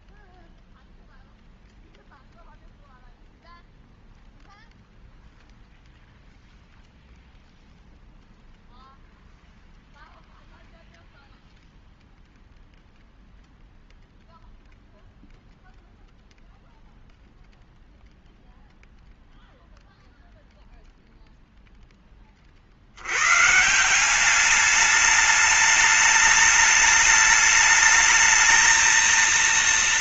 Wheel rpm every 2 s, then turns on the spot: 0, 0, 0, 0, 0, 0, 0, 0, 0, 0, 0, 40, 200, 210, 220.
none